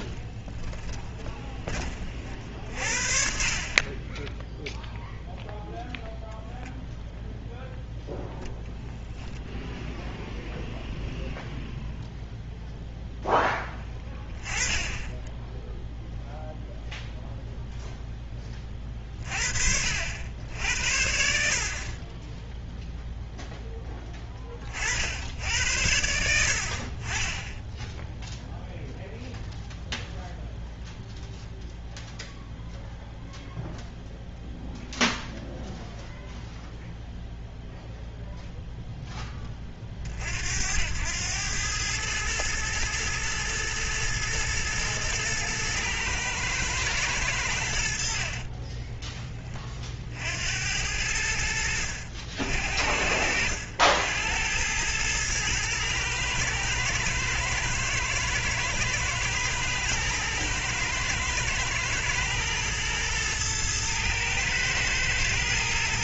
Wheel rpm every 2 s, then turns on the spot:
20, 50, 0, 0, 0, 0, 0, 10, 0, 30, 70, 0, 60, 40, 0, 0, 0, 0, 0, 0, 80, 110, 110, 110, 20, 80, 70, 100, 110, 110, 110, 110, 110.
0-2 48-50